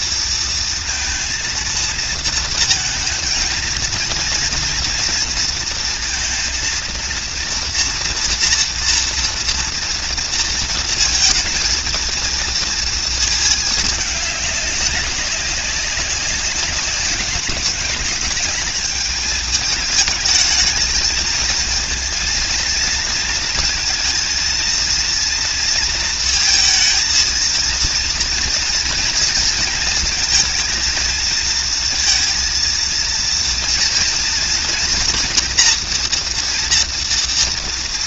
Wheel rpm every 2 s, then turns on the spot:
230, 230, 240, 230, 230, 230, 230, 200, 200, 210, 220, 230, 230, 230, 230, 220, 230, 240, 240.
none